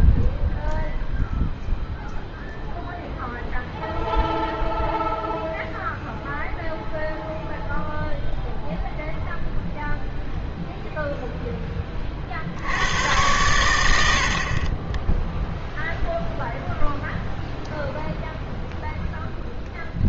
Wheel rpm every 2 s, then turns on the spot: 0, 0, 0, 0, 0, 0, 70, 30, 0, 0.
none